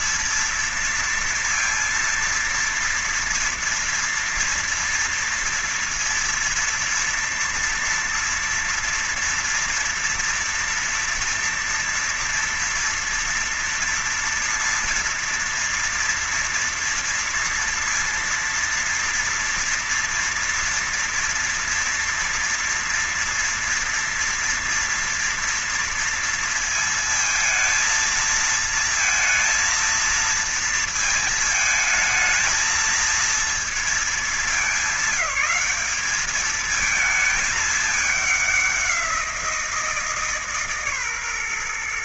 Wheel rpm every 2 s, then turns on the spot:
230, 230, 230, 230, 230, 230, 230, 240, 230, 230, 230, 240, 230, 230, 230, 230, 220, 210, 210, 200, 150.
none